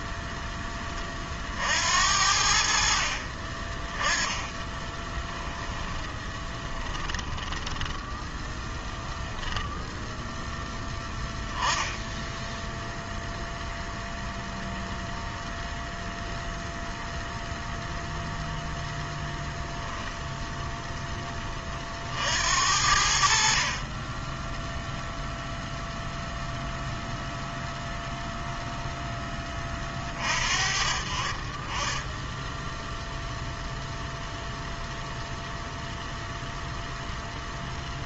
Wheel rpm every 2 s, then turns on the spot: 20, 60, 10, 10, 10, 10, 0, 0, 0, 0, 10, 70, 0, 0, 10, 40, 0, 0, 0.
4-8